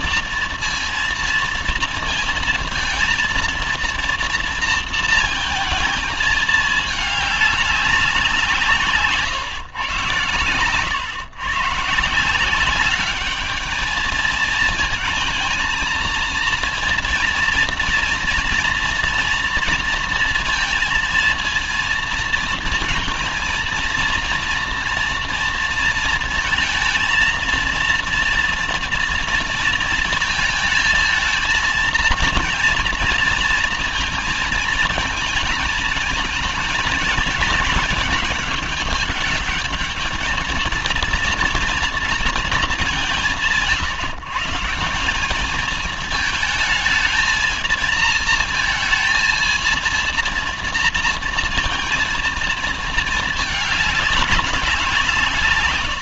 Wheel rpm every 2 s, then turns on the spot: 230, 230, 230, 220, 180, 130, 180, 220, 230, 240, 230, 230, 230, 230, 230, 230, 230, 230, 220, 210, 220, 220, 140, 220, 220, 230, 230, 190.
none